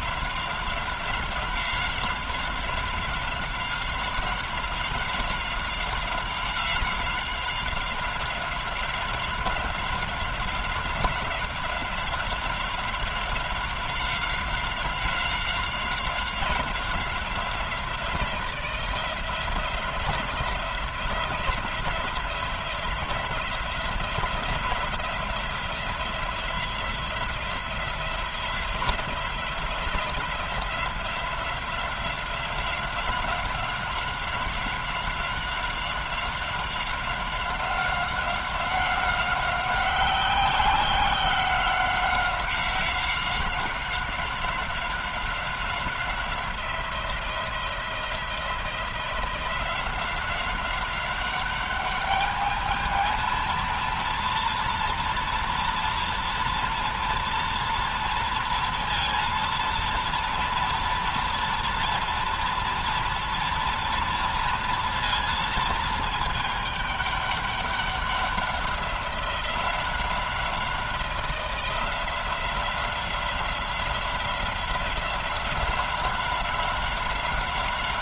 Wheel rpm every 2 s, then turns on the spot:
190, 180, 190, 190, 190, 190, 190, 180, 180, 170, 180, 170, 180, 170, 170, 180, 190, 190, 190, 190, 180, 190, 190, 180, 170, 190, 220, 240, 230, 230, 230, 230, 230, 210, 190, 180, 180, 180, 190.
none